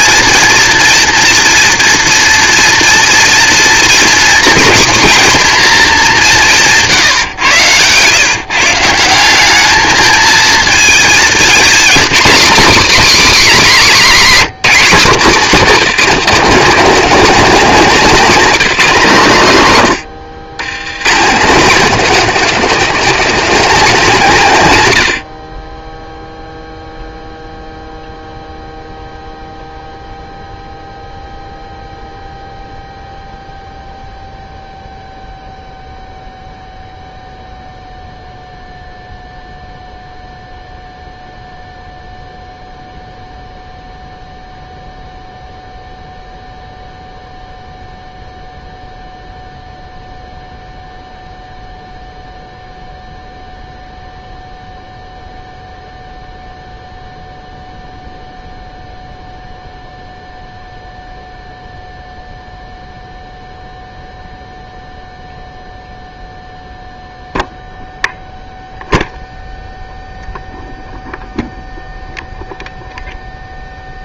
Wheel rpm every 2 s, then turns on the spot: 230, 240, 240, 170, 150, 220, 240, 240, 240, 240, 110, 250, 180, 0, 0, 0, 0, 0, 0, 0, 0, 0, 0, 0, 0, 0, 0, 0, 0, 0, 0, 0, 0, 0, 0, 0, 0.
none